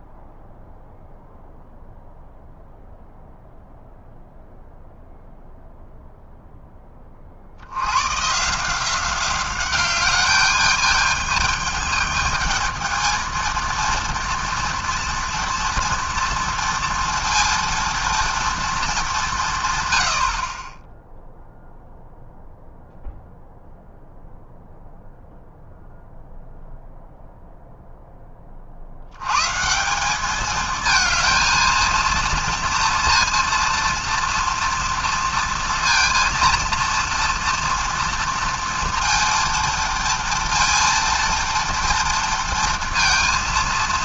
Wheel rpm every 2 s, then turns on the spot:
0, 0, 0, 10, 160, 210, 220, 230, 230, 230, 30, 0, 0, 0, 60, 220, 230, 230, 230, 230, 230, 230.
none